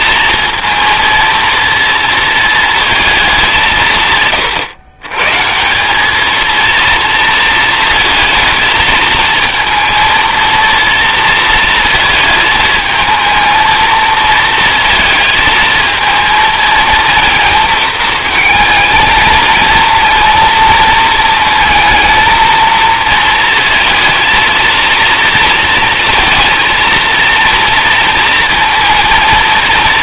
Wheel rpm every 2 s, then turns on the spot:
230, 200, 130, 230, 230, 230, 230, 230, 230, 220, 220, 230, 230, 230, 230.
none